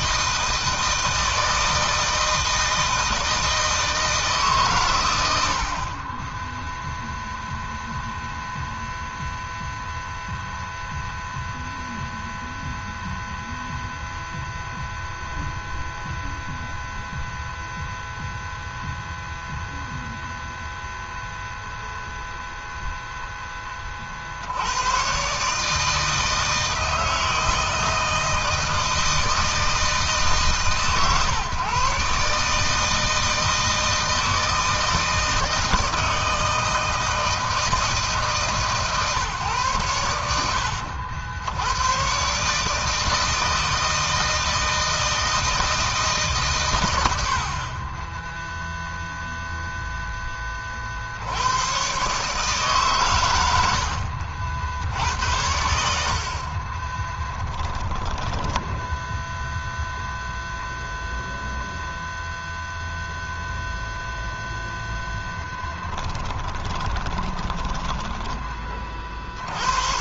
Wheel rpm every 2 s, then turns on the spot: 160, 160, 90, 0, 0, 0, 0, 0, 0, 0, 0, 10, 130, 160, 160, 140, 160, 160, 160, 140, 80, 160, 160, 80, 0, 70, 110, 80, 20, 0, 0, 0, 0, 20, 70.
56-58 66-68